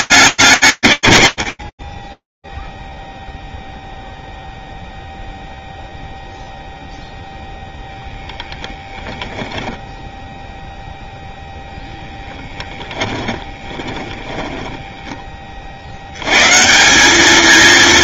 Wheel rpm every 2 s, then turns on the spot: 90, 0, 0, 0, 0, 10, 20, 90, 220.
12-14